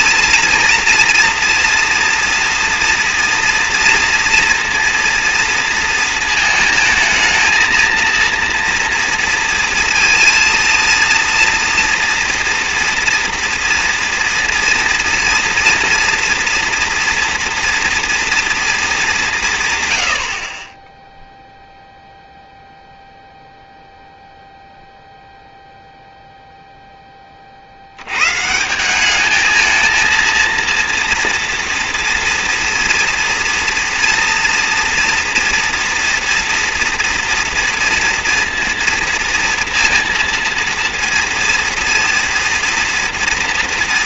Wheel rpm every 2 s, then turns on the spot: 230, 230, 230, 220, 230, 230, 230, 230, 230, 230, 30, 0, 0, 0, 150, 230, 230, 240, 240, 230, 230, 230.
none